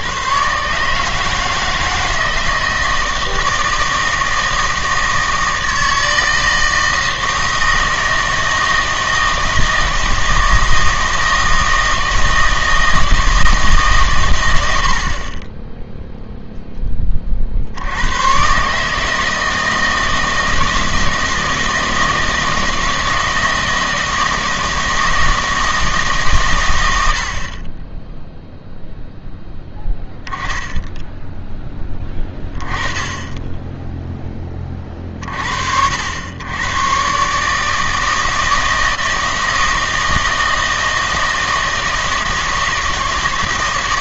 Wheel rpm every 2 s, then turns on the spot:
130, 160, 160, 160, 160, 160, 160, 90, 10, 140, 160, 160, 160, 110, 0, 10, 10, 20, 110, 160, 160, 160.
none